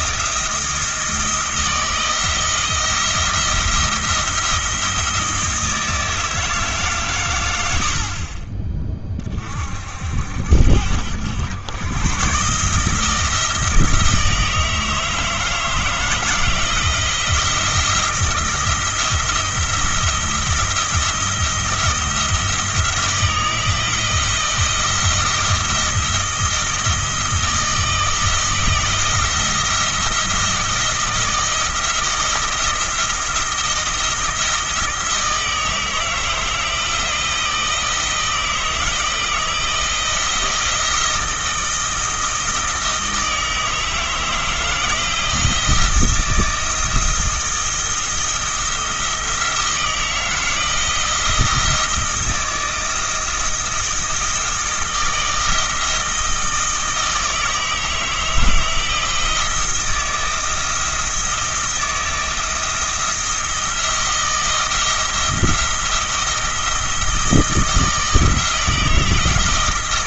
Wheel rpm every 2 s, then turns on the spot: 170, 170, 170, 150, 20, 70, 150, 160, 160, 170, 160, 160, 170, 160, 170, 160, 170, 160, 160, 160, 170, 160, 160, 170, 170, 170, 160, 160, 160, 160, 160, 170, 170, 170, 160.
none